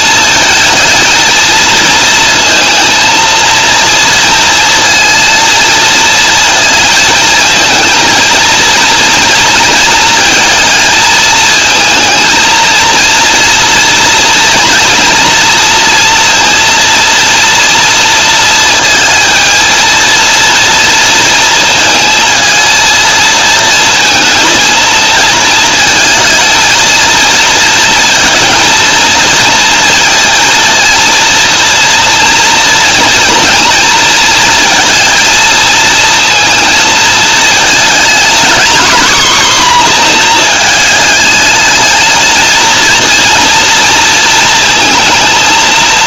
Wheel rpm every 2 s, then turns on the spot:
230, 230, 230, 220, 230, 230, 230, 230, 230, 230, 230, 230, 230, 230, 220, 230, 230, 230, 230, 240, 220, 230, 220.
none